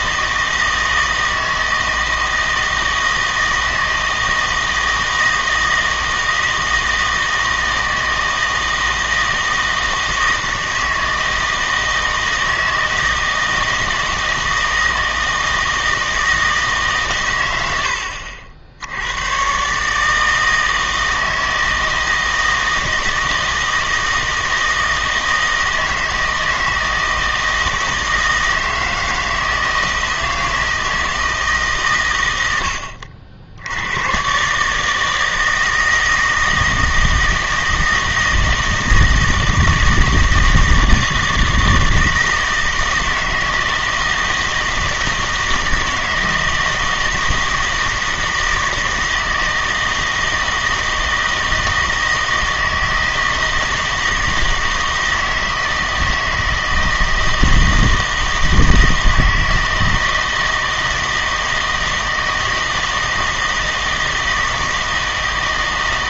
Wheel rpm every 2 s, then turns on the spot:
160, 160, 160, 160, 160, 160, 160, 160, 150, 70, 160, 160, 160, 160, 160, 160, 80, 150, 160, 160, 160, 160, 160, 160, 160, 160, 160, 160, 160, 160, 160, 160, 160.
none